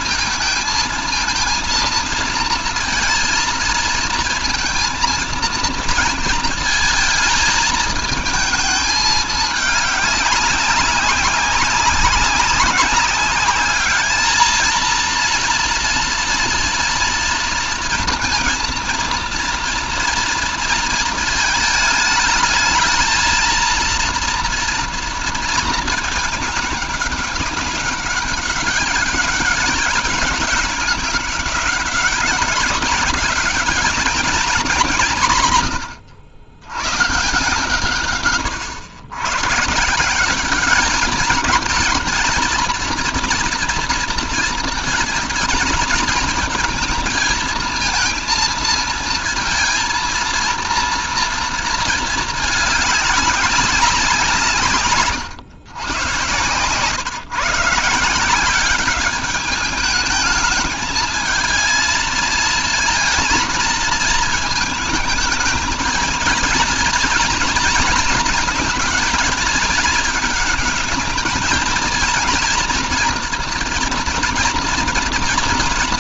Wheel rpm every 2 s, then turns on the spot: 230, 230, 230, 230, 220, 200, 200, 230, 230, 230, 220, 220, 230, 210, 200, 200, 200, 200, 120, 100, 210, 230, 230, 220, 230, 230, 210, 140, 130, 190, 220, 230, 220, 230, 230, 220, 230, 230.
none